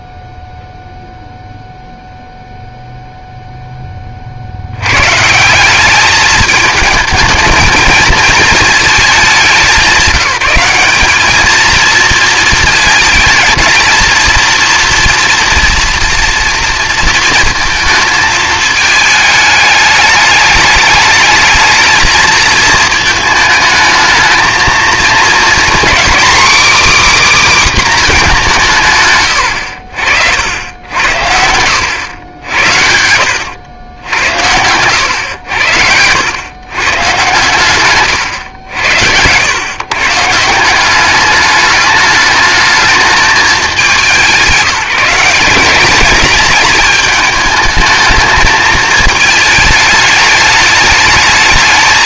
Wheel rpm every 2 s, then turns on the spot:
0, 0, 80, 210, 220, 190, 220, 230, 230, 220, 210, 220, 220, 270, 180, 80, 80, 90, 120, 80, 150, 210, 190, 210, 220, 210.
none